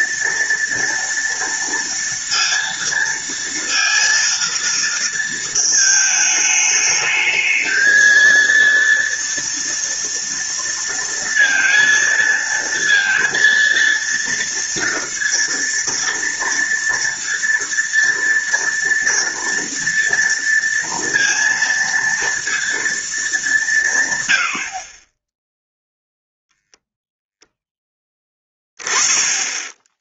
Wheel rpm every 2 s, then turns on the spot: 230, 230, 230, 210, 230, 230, 230, 230, 230, 230, 230, 230, 50, 0, 20.
none